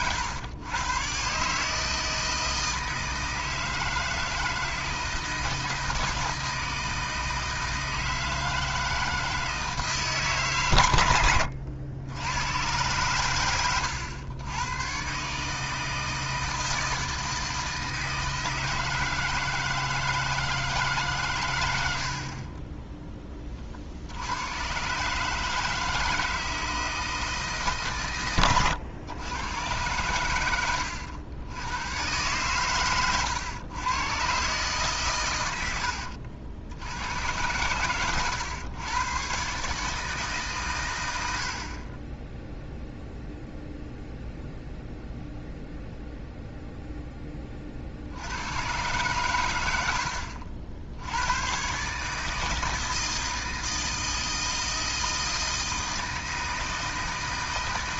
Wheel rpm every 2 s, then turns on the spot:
120, 160, 160, 160, 160, 130, 120, 120, 160, 160, 150, 10, 120, 160, 110, 90, 120, 130, 80, 110, 120, 0, 0, 0, 110, 70, 160, 160, 160.
none